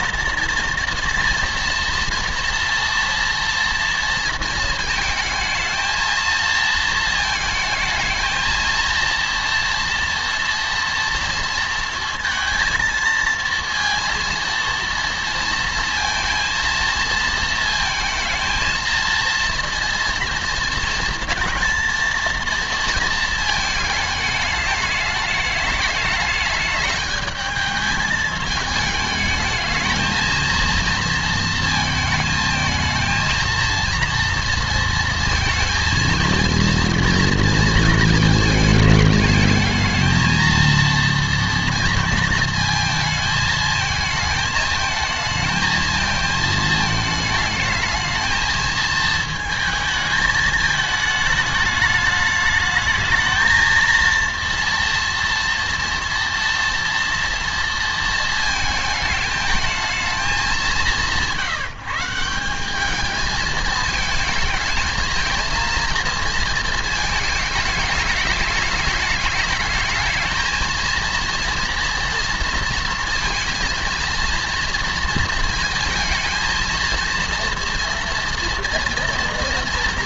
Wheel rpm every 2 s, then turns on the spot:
230, 230, 220, 230, 230, 230, 230, 230, 230, 230, 230, 230, 210, 210, 220, 230, 220, 230, 230, 220, 230, 220, 220, 220, 220, 220, 220, 230, 240, 220, 200, 190, 220, 230, 210, 220, 230, 240, 230, 230.
none